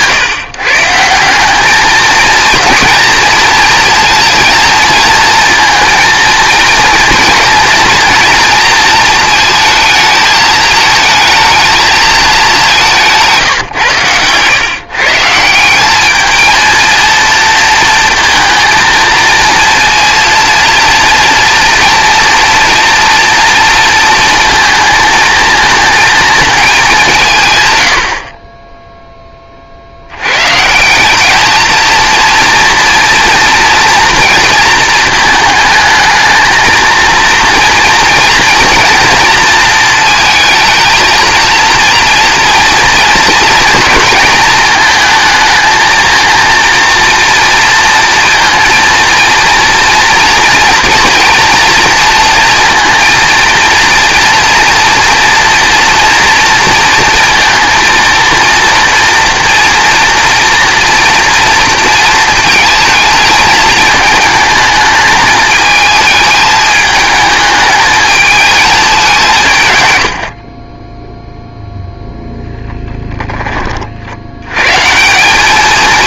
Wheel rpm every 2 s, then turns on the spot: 150, 230, 230, 230, 230, 220, 180, 130, 230, 230, 230, 230, 220, 200, 10, 180, 240, 230, 220, 230, 220, 230, 220, 230, 230, 240, 230, 230, 230, 240, 240, 220, 220, 220, 200, 10, 10, 150.
70-72